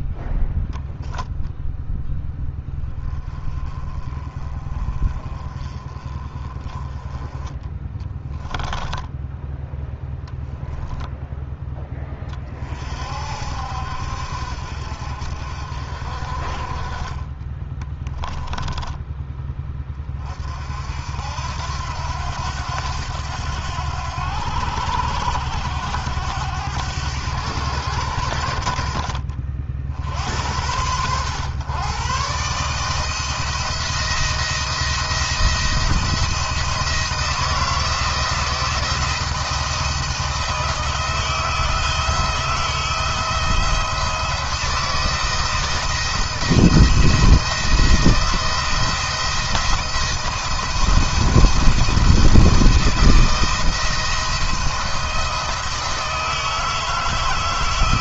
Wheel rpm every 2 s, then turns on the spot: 10, 10, 30, 20, 10, 0, 40, 60, 30, 10, 60, 90, 90, 100, 60, 90, 150, 170, 170, 170, 160, 160, 160, 160, 160, 170, 160, 170, 160.
none